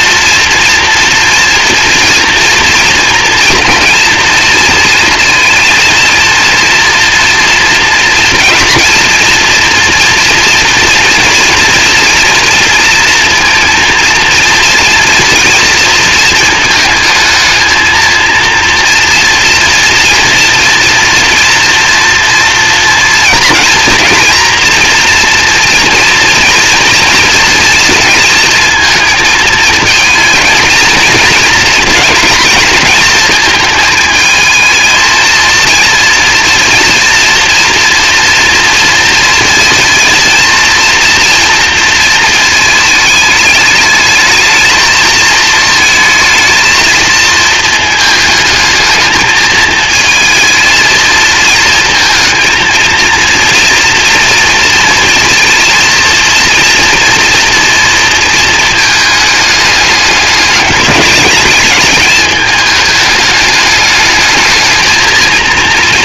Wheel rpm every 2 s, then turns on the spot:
230, 230, 230, 230, 240, 230, 230, 230, 220, 230, 230, 230, 240, 230, 230, 220, 220, 230, 230, 230, 230, 220, 220, 220, 220, 220, 230, 230, 230, 220, 210, 210, 220.
none